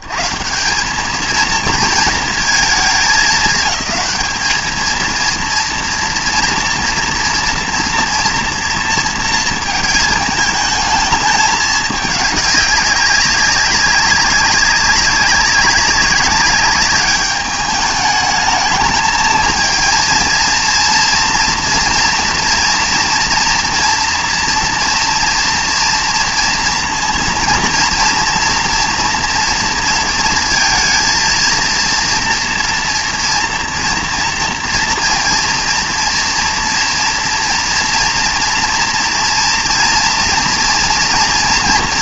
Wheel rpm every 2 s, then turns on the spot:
140, 220, 220, 230, 230, 220, 210, 190, 200, 220, 230, 230, 230, 230, 230, 230, 230, 230, 230, 230, 230.
none